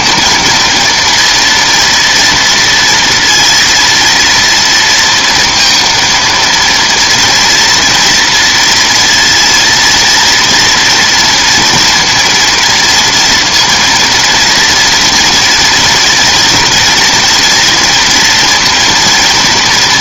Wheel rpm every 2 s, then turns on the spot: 230, 230, 230, 230, 230, 230, 230, 240, 230, 230.
none